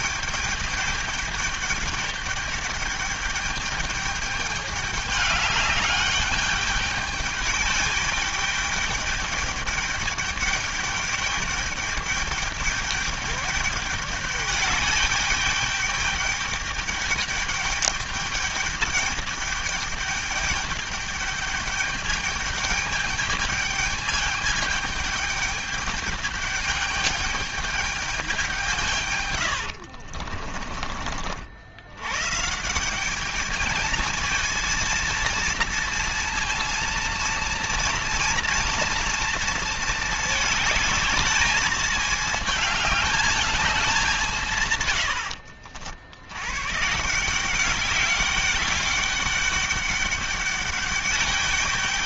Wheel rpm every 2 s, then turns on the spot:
210, 210, 210, 210, 210, 210, 210, 210, 210, 210, 210, 210, 210, 210, 160, 40, 190, 230, 230, 230, 210, 210, 110, 160, 200, 200.
44-46